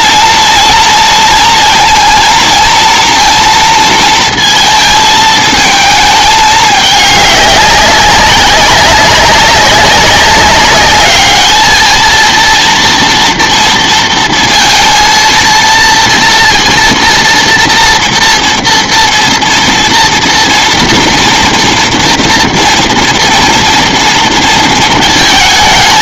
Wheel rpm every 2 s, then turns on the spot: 230, 230, 220, 210, 190, 200, 230, 230, 230, 230, 230, 230, 230.
none